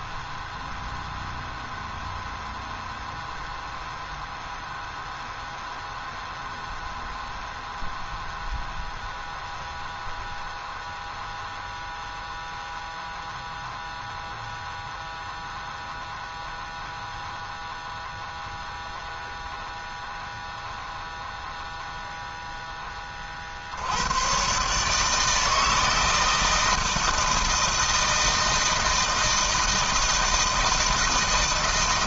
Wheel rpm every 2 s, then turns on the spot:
0, 0, 0, 0, 0, 0, 0, 0, 0, 0, 0, 0, 130, 160, 160, 160.
none